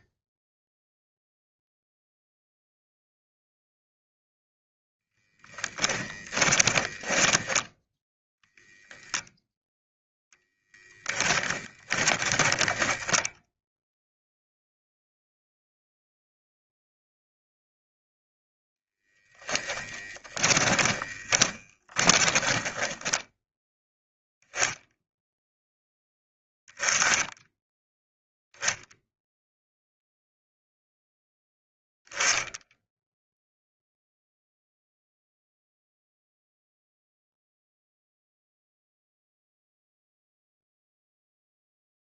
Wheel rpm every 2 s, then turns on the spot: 0, 0, 0, 20, 0, 10, 10, 0, 0, 0, 20, 20, 0, 10, 0, 0, 0, 0, 0, 0, 0.
6-8 12-14 20-24